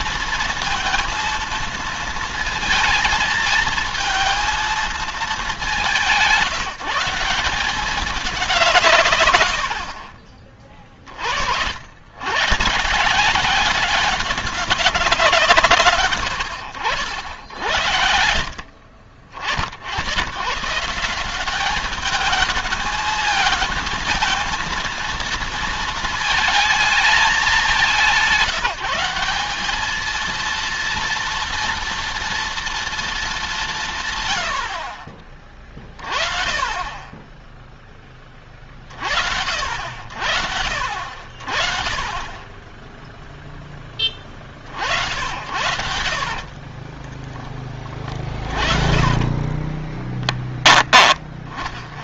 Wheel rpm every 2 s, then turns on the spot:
230, 230, 220, 170, 130, 40, 160, 190, 90, 50, 170, 220, 230, 220, 180, 230, 230, 50, 30, 40, 50, 10, 60, 20, 20, 20.
46-50